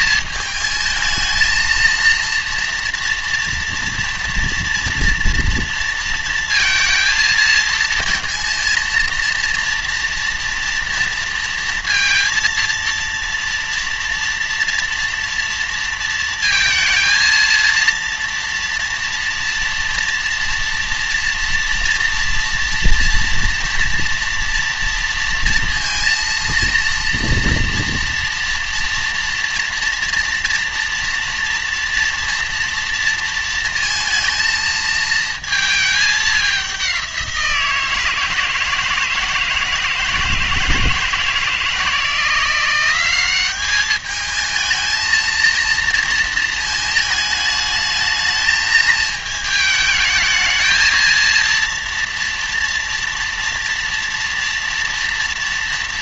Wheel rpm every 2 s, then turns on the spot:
220, 230, 230, 230, 230, 230, 230, 230, 220, 240, 240, 230, 230, 230, 230, 230, 230, 220, 190, 160, 160, 180, 220, 220, 220, 230, 230, 230.
none